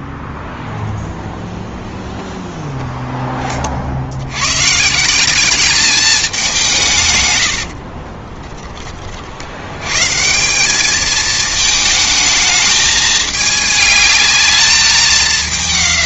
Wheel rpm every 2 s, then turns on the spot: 0, 0, 130, 170, 20, 190, 220, 210.
none